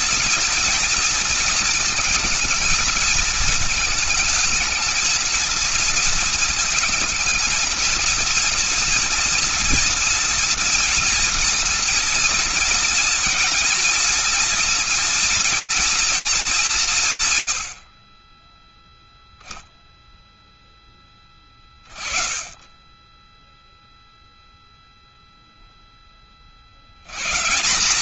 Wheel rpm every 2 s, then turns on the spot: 230, 230, 220, 230, 230, 230, 230, 230, 210, 20, 0, 20, 0, 50.
none